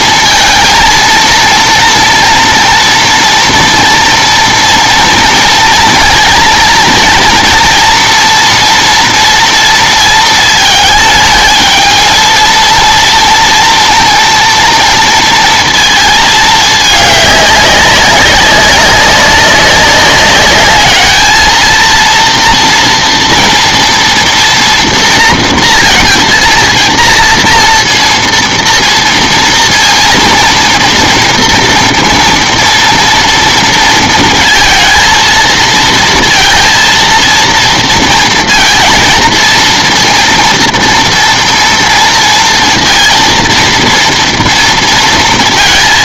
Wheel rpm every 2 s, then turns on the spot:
220, 230, 230, 230, 230, 220, 230, 230, 210, 200, 210, 230, 230, 230, 230, 230, 230, 220, 230, 230, 230, 230, 230.
none